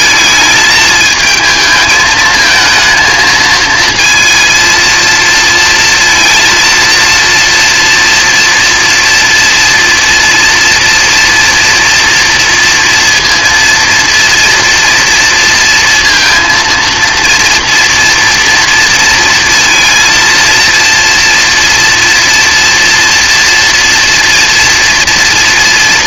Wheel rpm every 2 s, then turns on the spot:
220, 220, 230, 230, 230, 230, 230, 230, 230, 230, 230, 230, 240.
none